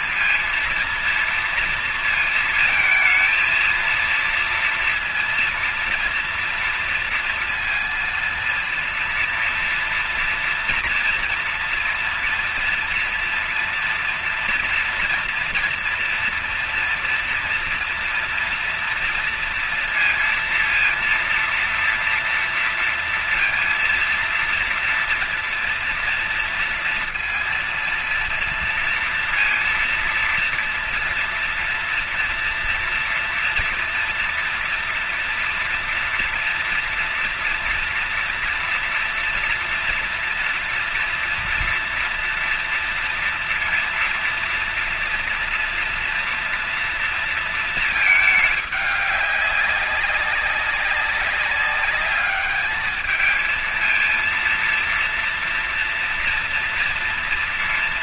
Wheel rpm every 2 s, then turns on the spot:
230, 220, 230, 230, 230, 240, 230, 230, 230, 230, 230, 230, 230, 230, 230, 230, 240, 230, 230, 230, 230, 230, 230, 240, 220, 190, 210, 230, 230.
none